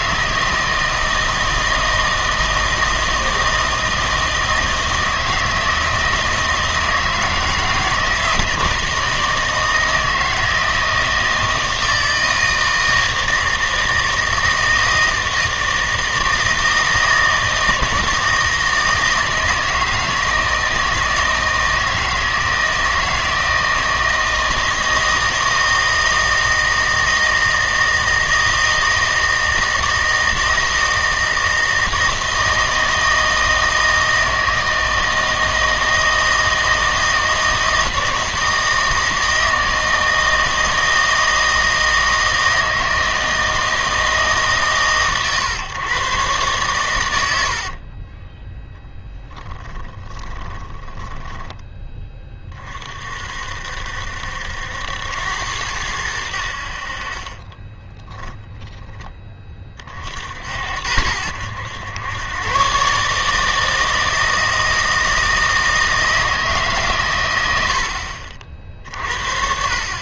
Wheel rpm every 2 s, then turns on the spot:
160, 160, 160, 160, 160, 160, 160, 160, 160, 160, 160, 160, 160, 160, 160, 160, 160, 160, 160, 160, 160, 160, 120, 80, 10, 10, 60, 90, 30, 20, 90, 150, 160, 100, 50.
46-48 50-52 56-58